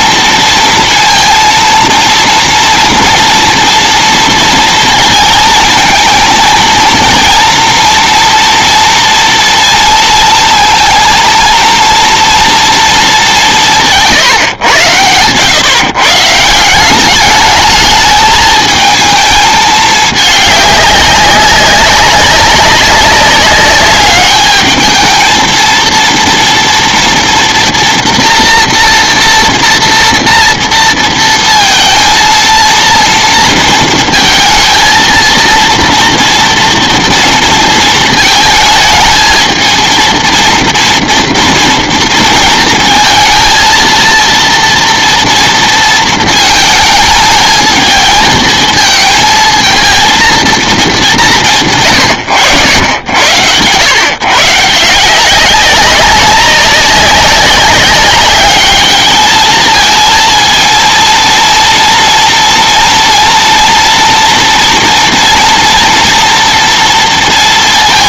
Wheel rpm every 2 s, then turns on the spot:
230, 230, 230, 230, 230, 230, 220, 110, 180, 220, 200, 190, 210, 230, 230, 230, 230, 220, 230, 220, 230, 230, 230, 220, 220, 210, 100, 160, 200, 210, 230, 230, 240, 230.
none